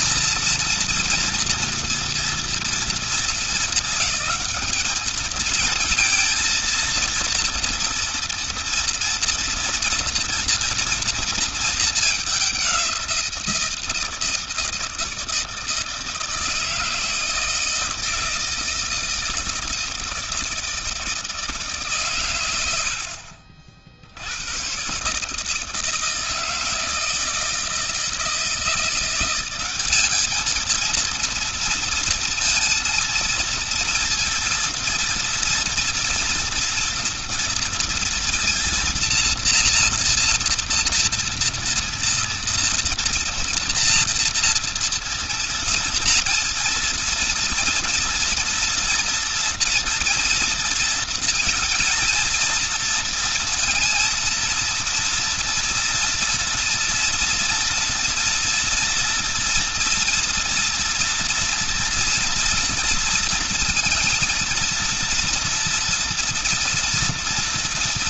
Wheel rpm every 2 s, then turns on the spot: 230, 230, 210, 230, 240, 230, 200, 160, 160, 160, 160, 100, 90, 160, 170, 220, 230, 230, 230, 230, 230, 230, 230, 230, 230, 230, 230, 230, 230, 230, 230, 230, 230, 230.
none